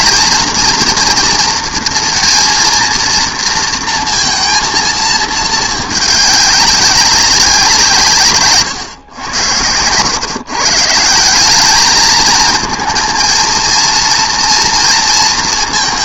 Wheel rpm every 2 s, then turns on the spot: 220, 230, 230, 200, 130, 150, 230, 230.
8-10